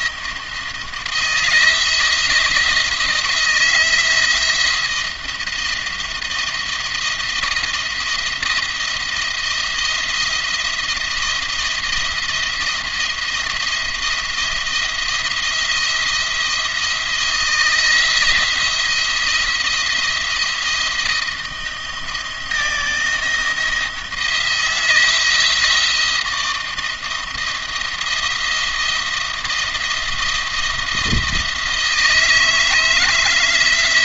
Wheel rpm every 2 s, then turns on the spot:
170, 160, 170, 170, 170, 170, 170, 170, 170, 170, 170, 160, 170, 170, 170, 170, 160.
none